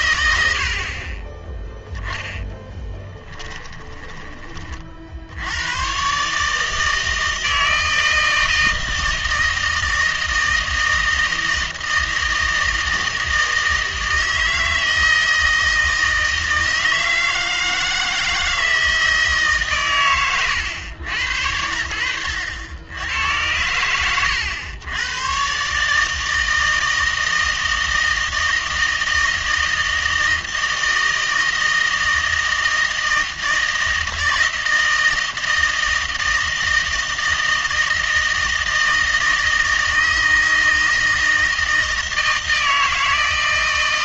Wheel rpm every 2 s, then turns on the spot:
70, 10, 30, 150, 160, 160, 160, 160, 160, 160, 110, 90, 100, 160, 160, 160, 160, 160, 160, 160, 160, 160.
2-4